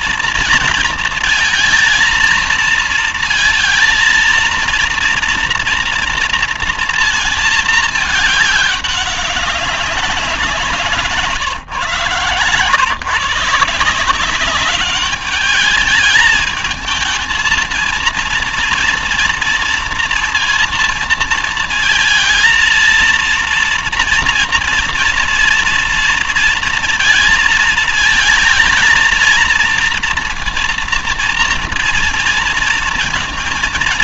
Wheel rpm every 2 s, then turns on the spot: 230, 220, 230, 230, 210, 170, 140, 200, 220, 230, 230, 230, 230, 230, 220, 230, 230.
none